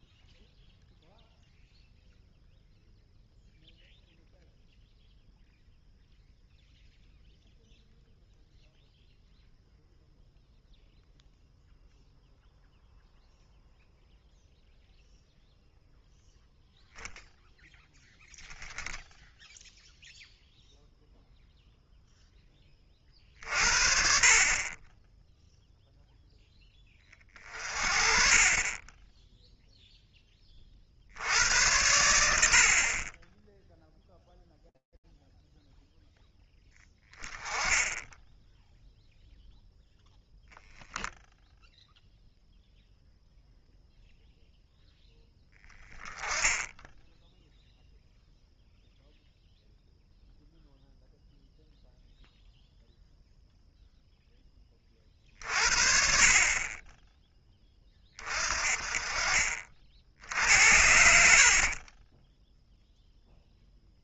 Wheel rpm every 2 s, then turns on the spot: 0, 0, 0, 0, 0, 0, 0, 0, 0, 0, 0, 0, 40, 0, 30, 0, 100, 0, 10, 0, 0, 0, 0, 10, 0, 0, 0, 20, 40, 30, 90, 0.
none